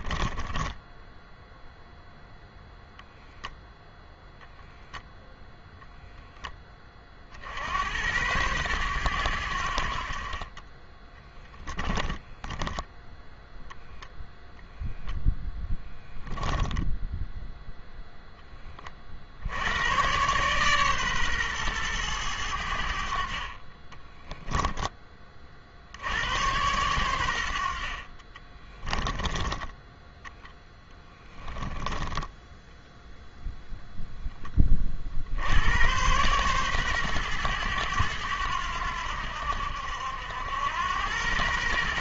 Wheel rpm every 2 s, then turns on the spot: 20, 0, 0, 20, 110, 30, 0, 0, 10, 20, 130, 90, 10, 100, 10, 10, 0, 30, 120, 90, 90.
0-2 16-18 28-30